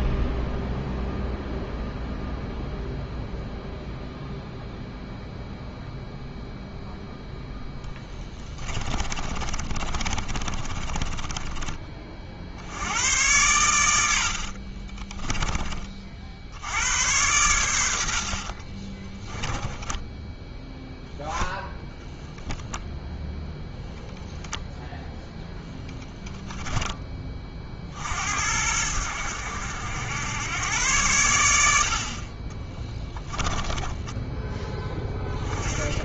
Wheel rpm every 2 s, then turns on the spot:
0, 0, 0, 0, 20, 30, 80, 40, 90, 30, 0, 0, 0, 10, 80, 100, 20, 10.
8-12 14-16 18-20 32-34